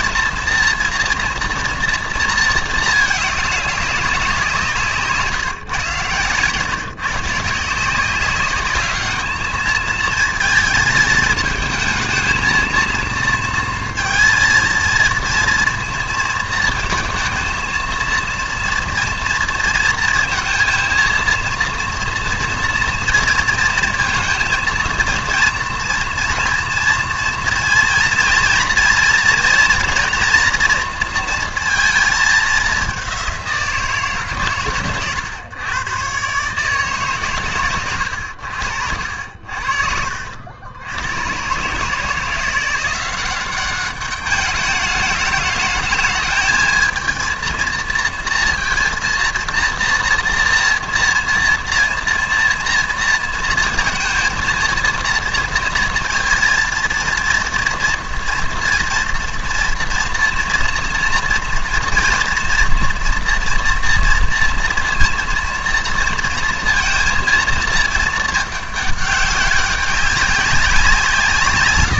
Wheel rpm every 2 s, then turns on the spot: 230, 230, 180, 130, 200, 220, 220, 230, 220, 230, 230, 230, 230, 230, 230, 240, 200, 120, 140, 80, 80, 170, 210, 220, 230, 230, 230, 230, 230, 230, 230, 230, 230, 230, 210, 190.
38-40